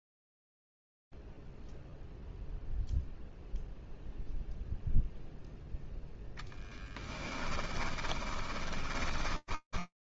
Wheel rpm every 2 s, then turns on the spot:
0, 0, 0, 0, 20.
8-10